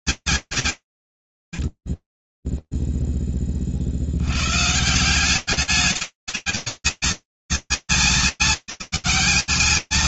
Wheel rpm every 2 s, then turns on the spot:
140, 0, 100, 220, 210.
none